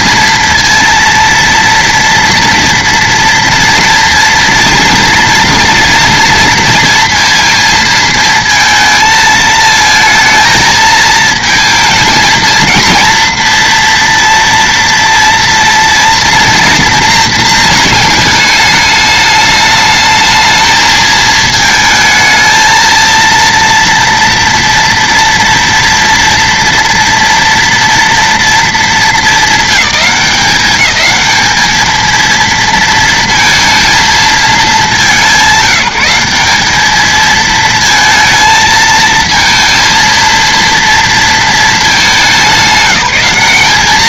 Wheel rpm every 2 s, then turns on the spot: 230, 230, 230, 230, 220, 220, 230, 230, 230, 210, 220, 220, 240, 240, 220, 190, 230, 210, 190, 220, 230, 200.
none